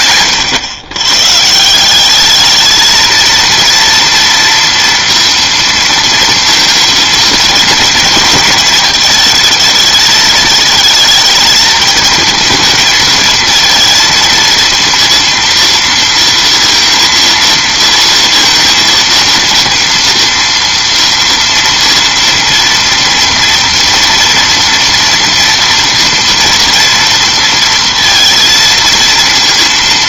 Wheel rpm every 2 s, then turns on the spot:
120, 220, 230, 230, 220, 220, 230, 230, 230, 230, 230, 230, 230, 230, 230.
none